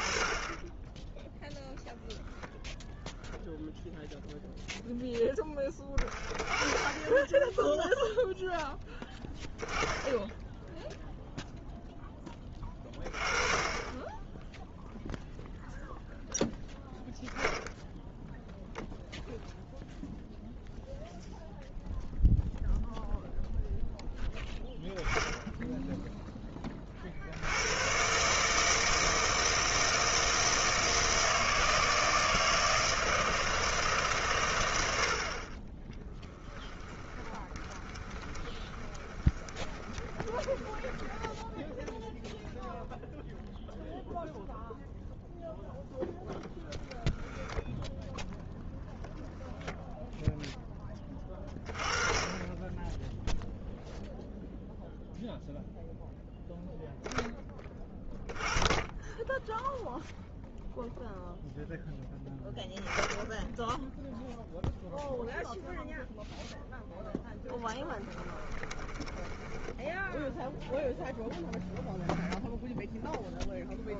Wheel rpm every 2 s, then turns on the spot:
10, 10, 0, 20, 0, 0, 20, 10, 0, 0, 0, 0, 10, 20, 160, 160, 160, 100, 10, 20, 10, 0, 0, 0, 0, 10, 10, 0, 0, 10, 0, 0, 0, 0, 10, 0, 0.
36-42 68-70